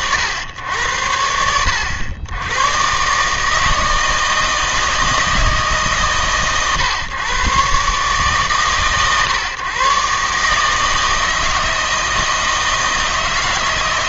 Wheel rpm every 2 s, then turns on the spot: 90, 110, 160, 120, 110, 160, 160.
none